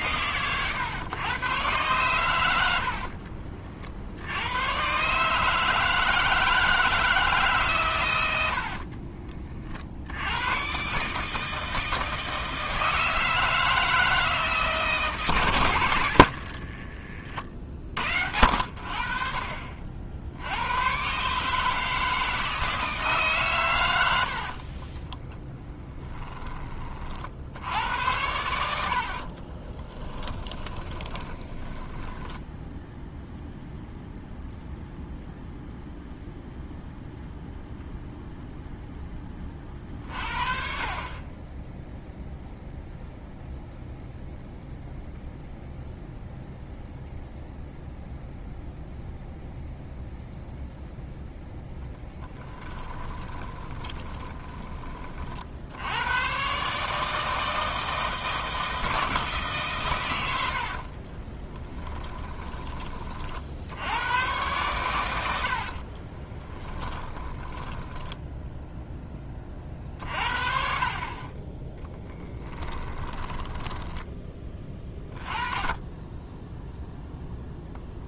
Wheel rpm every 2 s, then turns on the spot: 120, 70, 120, 170, 50, 130, 160, 150, 40, 70, 100, 160, 20, 30, 70, 10, 0, 0, 0, 0, 60, 0, 0, 0, 0, 0, 20, 30, 150, 160, 50, 20, 110, 20, 10, 40, 10, 20, 0.
2-4 8-10 16-18 24-26 30-32 52-54 60-62 66-68 72-74